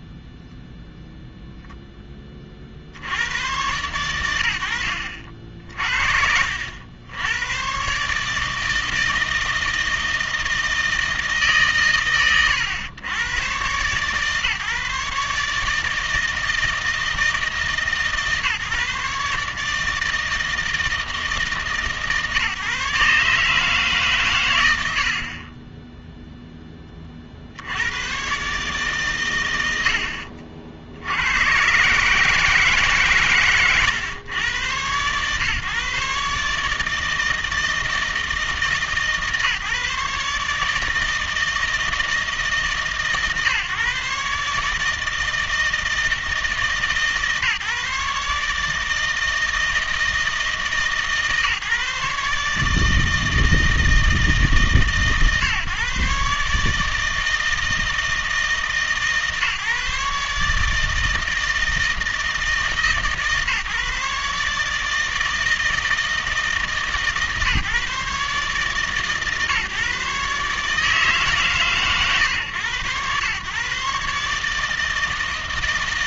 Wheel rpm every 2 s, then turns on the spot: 0, 40, 80, 80, 160, 160, 110, 150, 160, 150, 160, 140, 70, 10, 140, 70, 140, 120, 150, 160, 150, 150, 150, 150, 150, 150, 150, 150, 150, 150, 150, 150, 150, 160, 140, 150, 120, 150.
none